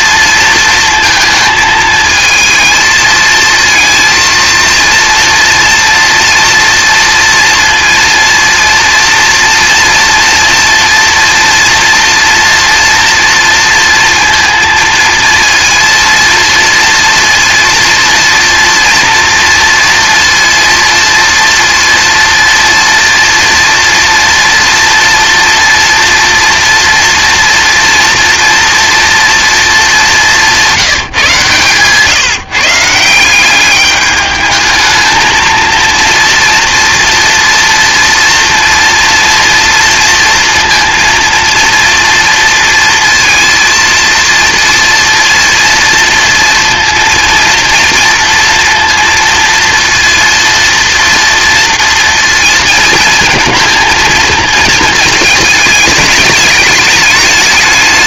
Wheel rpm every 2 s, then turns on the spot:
230, 230, 230, 230, 230, 240, 240, 230, 230, 230, 230, 230, 230, 230, 230, 180, 160, 220, 240, 230, 230, 230, 230, 230, 230, 230, 220, 220, 210.
none